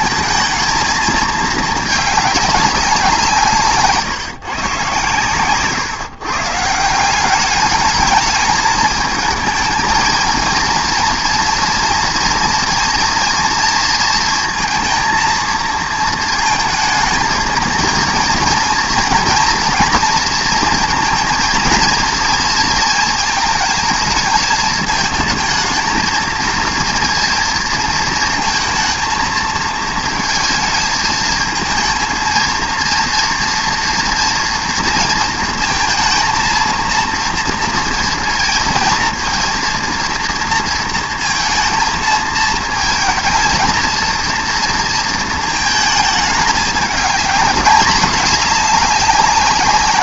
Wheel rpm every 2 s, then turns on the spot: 220, 200, 130, 150, 220, 230, 230, 230, 220, 230, 230, 220, 220, 230, 220, 220, 230, 230, 230, 230, 230, 220, 230, 210, 210.
none